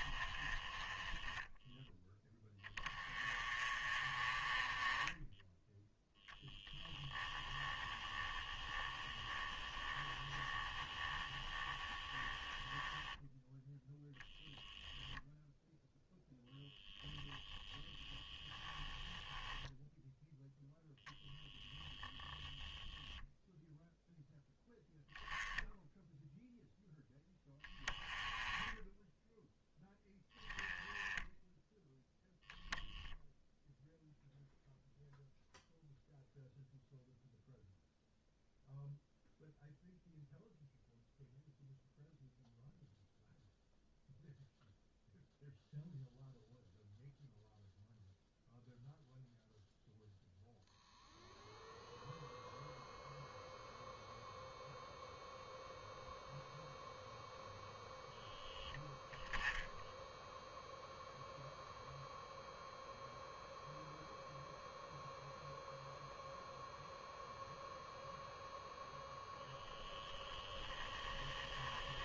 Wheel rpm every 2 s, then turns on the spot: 10, 20, 10, 10, 10, 10, 0, 0, 0, 10, 0, 0, 0, 0, 10, 10, 0, 0, 0, 0, 0, 0, 0, 0, 0, 0, 0, 0, 0, 0, 0, 0, 0, 0, 0, 10.
6-12 70-72